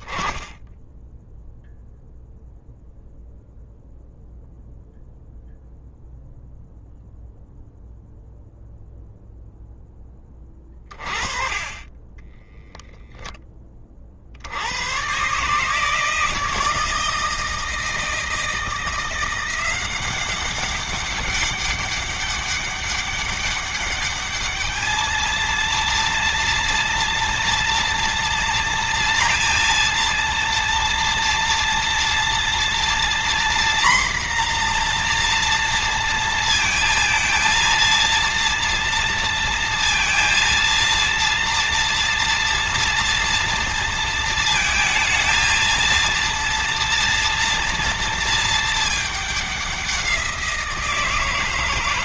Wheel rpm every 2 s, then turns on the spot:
10, 0, 0, 0, 0, 30, 0, 120, 160, 170, 200, 200, 220, 230, 230, 230, 240, 240, 230, 230, 230, 230, 220, 230, 210, 170.
none